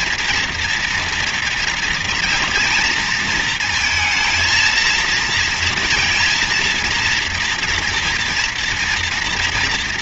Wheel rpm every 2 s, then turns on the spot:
230, 230, 230, 230, 230.
none